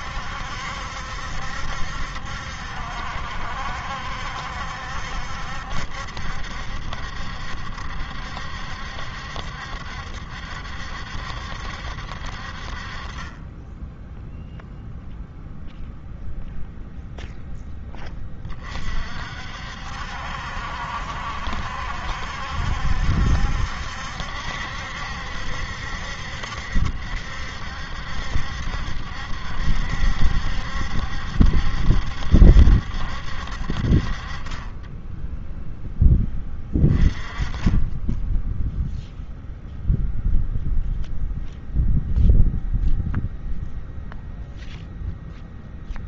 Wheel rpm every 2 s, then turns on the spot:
70, 70, 70, 70, 70, 70, 40, 0, 0, 40, 70, 70, 70, 70, 70, 70, 70, 10, 20, 0, 0, 0, 0.
none